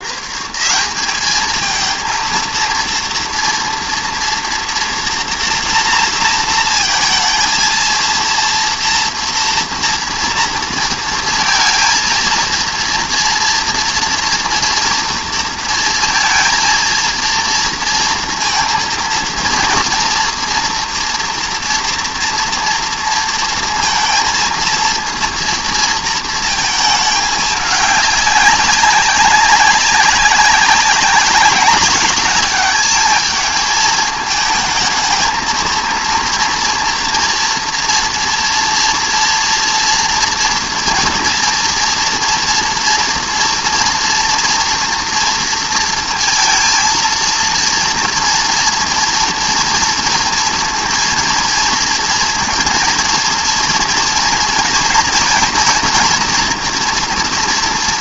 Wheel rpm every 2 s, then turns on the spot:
180, 230, 230, 230, 230, 230, 230, 230, 230, 230, 240, 230, 230, 220, 200, 200, 210, 220, 230, 230, 230, 230, 230, 230, 230, 230, 230, 230, 240.
none